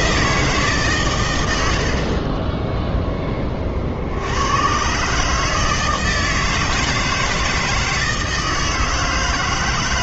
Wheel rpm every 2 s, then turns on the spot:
150, 10, 120, 160, 160.
2-4